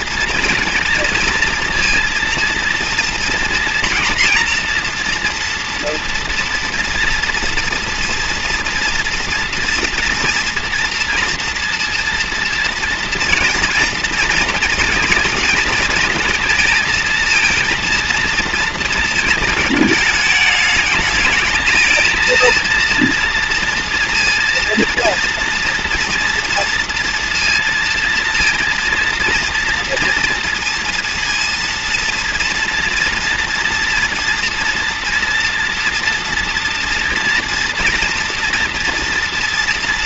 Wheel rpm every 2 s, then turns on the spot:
230, 230, 240, 230, 230, 230, 230, 230, 230, 230, 210, 230, 230, 230, 230, 230, 240, 230, 230, 230.
none